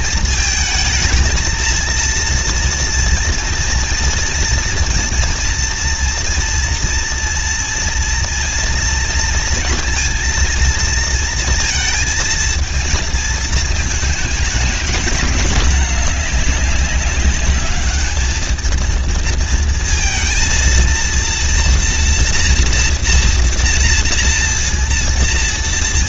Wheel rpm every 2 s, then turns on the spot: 220, 230, 230, 240, 240, 230, 220, 220, 200, 220, 230, 240, 230.
none